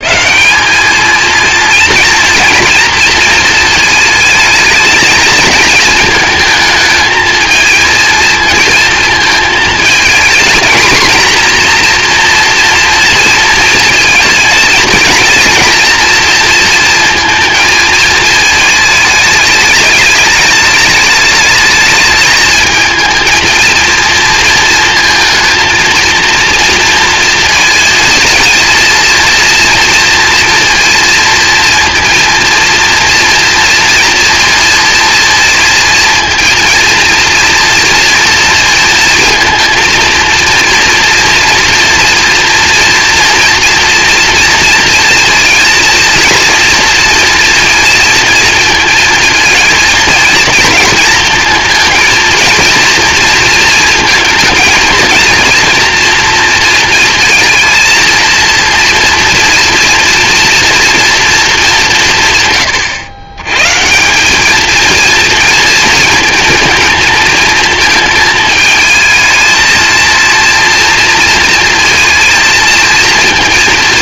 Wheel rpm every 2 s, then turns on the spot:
180, 230, 220, 220, 230, 230, 230, 220, 230, 220, 210, 220, 230, 230, 230, 230, 230, 230, 230, 230, 230, 240, 230, 230, 220, 230, 230, 230, 230, 230, 230, 120, 210, 230, 220, 230, 230.
none